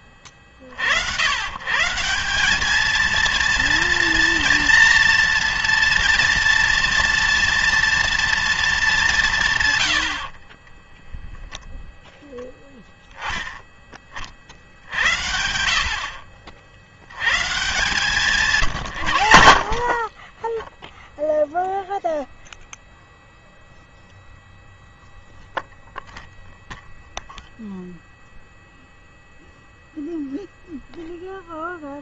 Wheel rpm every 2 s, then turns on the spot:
40, 200, 230, 230, 220, 20, 10, 60, 60, 150, 10, 0, 0, 0, 0, 0.
10-12 20-22